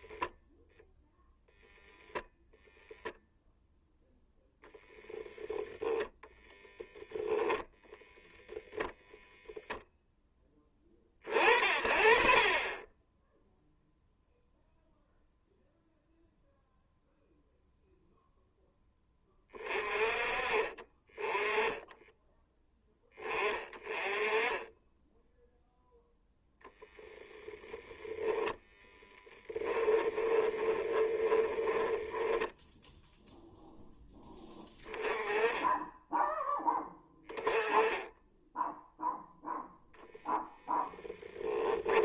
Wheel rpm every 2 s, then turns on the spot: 0, 0, 0, 0, 0, 30, 10, 0, 0, 0, 30, 10, 10, 0, 10, 20, 0, 20, 20, 0, 10.
28-32